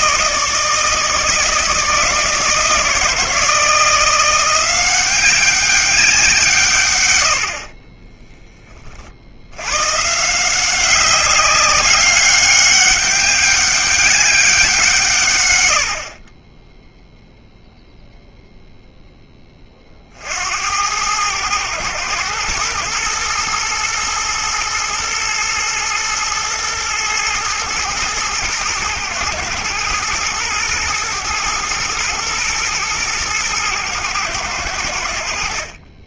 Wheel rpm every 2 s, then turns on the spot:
160, 160, 180, 130, 20, 180, 200, 180, 10, 0, 80, 120, 110, 120, 110, 110, 110, 90.
none